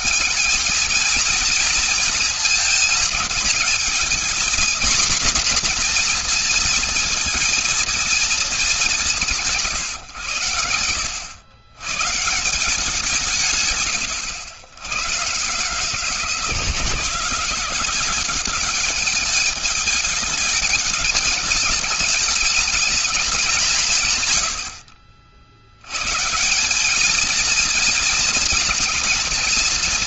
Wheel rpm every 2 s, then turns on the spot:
230, 230, 240, 230, 220, 120, 160, 110, 160, 190, 210, 210, 120, 170, 230.
none